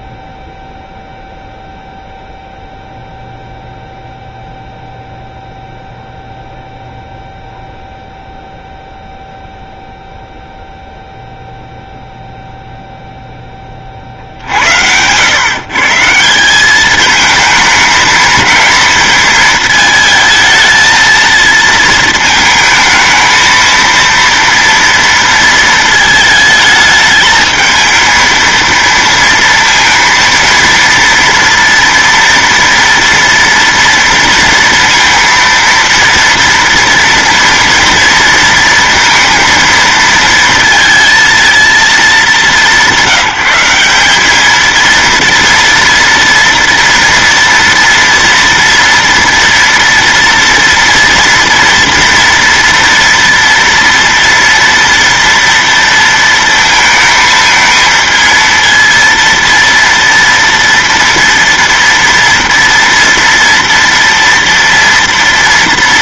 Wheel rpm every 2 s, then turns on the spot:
0, 0, 0, 0, 0, 0, 0, 70, 180, 220, 220, 220, 230, 220, 230, 230, 230, 230, 230, 230, 230, 190, 220, 240, 230, 230, 230, 230, 230, 230, 230, 230, 240.
none